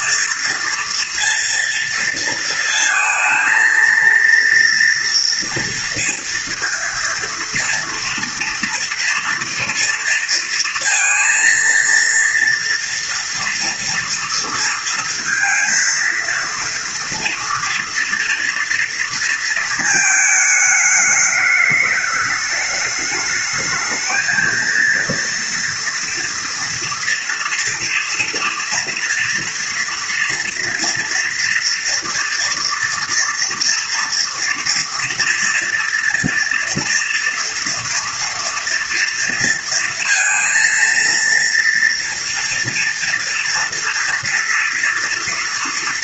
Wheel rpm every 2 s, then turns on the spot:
230, 220, 230, 230, 230, 230, 230, 230, 230, 230, 220, 210, 220, 230, 230, 230, 230, 240, 230, 230, 230, 230, 230.
none